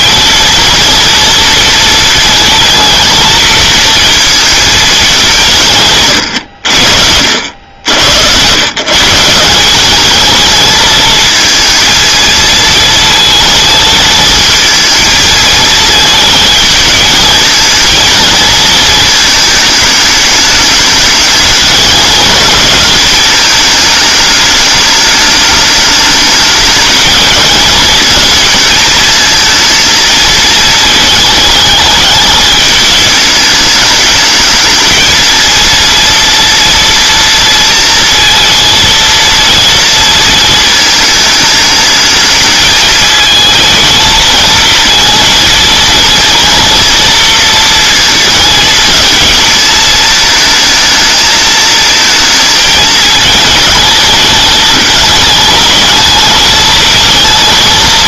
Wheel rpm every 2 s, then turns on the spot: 230, 230, 220, 90, 130, 220, 230, 220, 220, 220, 210, 220, 210, 220, 230, 220, 210, 220, 230, 230, 220, 220, 230, 240, 220, 220, 220, 210, 220.
none